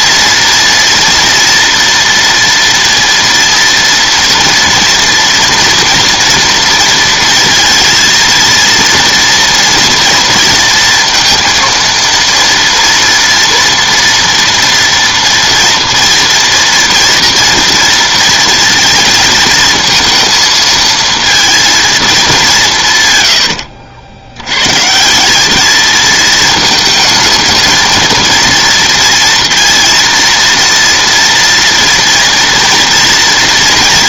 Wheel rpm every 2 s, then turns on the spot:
230, 230, 230, 230, 230, 230, 230, 230, 230, 230, 220, 140, 130, 220, 230, 230, 230.
none